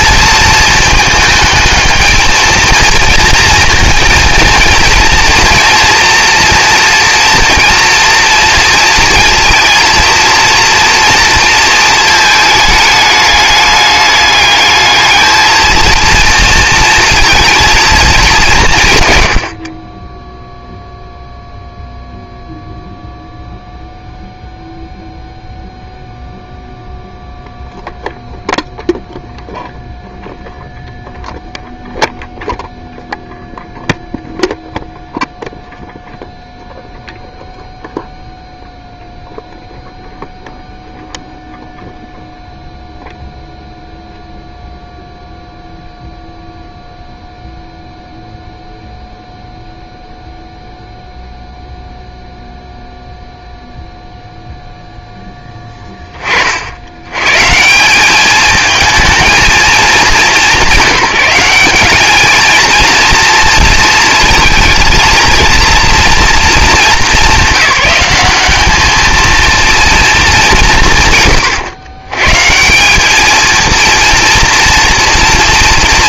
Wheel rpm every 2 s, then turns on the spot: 220, 230, 230, 230, 230, 230, 210, 210, 230, 160, 0, 0, 0, 0, 0, 0, 0, 0, 0, 0, 0, 0, 0, 0, 0, 0, 0, 0, 50, 210, 180, 220, 230, 220, 200, 170, 160, 240.
none